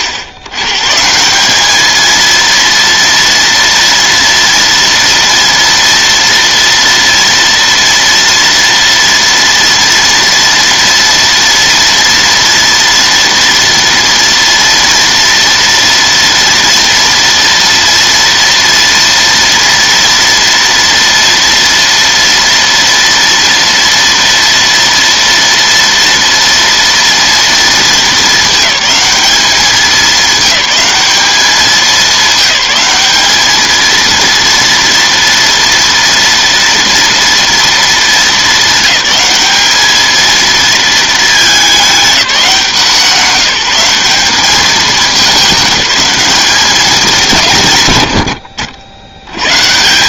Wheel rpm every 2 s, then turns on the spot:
100, 230, 230, 230, 230, 230, 230, 230, 230, 230, 230, 230, 230, 230, 220, 210, 200, 230, 230, 210, 220, 180, 210, 210, 80.
none